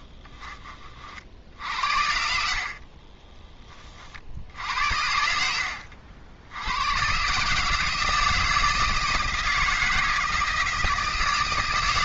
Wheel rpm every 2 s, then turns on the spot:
30, 40, 70, 110, 160, 160.
2-4